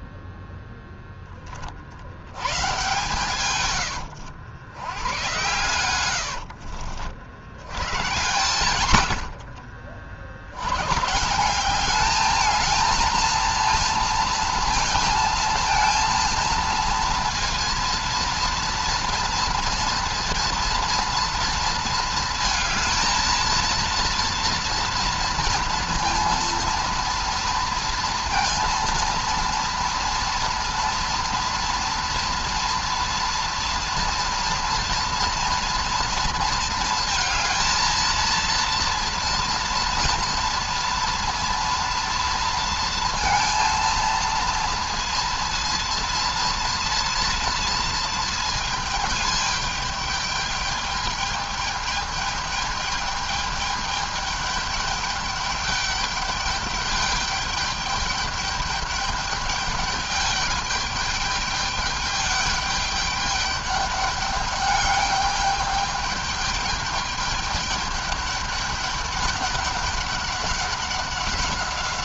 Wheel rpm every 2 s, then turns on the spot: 10, 120, 90, 50, 110, 120, 220, 230, 230, 230, 230, 220, 230, 230, 230, 230, 230, 230, 230, 230, 230, 230, 230, 230, 220, 210, 210, 210, 210, 210, 210, 200, 200, 210, 210, 200.
none